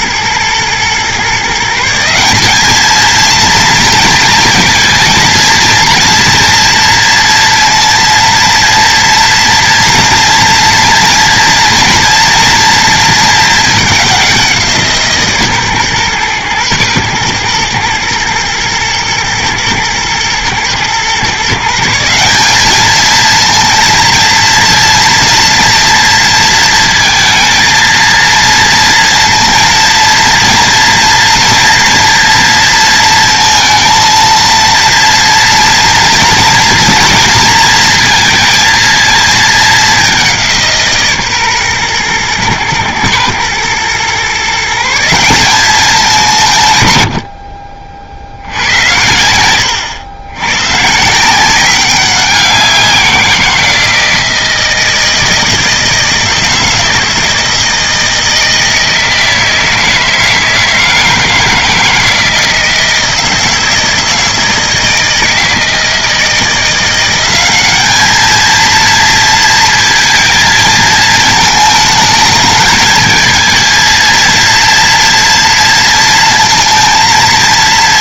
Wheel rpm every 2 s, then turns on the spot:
120, 210, 230, 230, 230, 230, 230, 170, 120, 110, 120, 210, 230, 230, 230, 230, 230, 230, 230, 230, 160, 110, 170, 120, 90, 130, 180, 160, 160, 160, 160, 160, 160, 170, 230, 220, 220, 230, 230.
none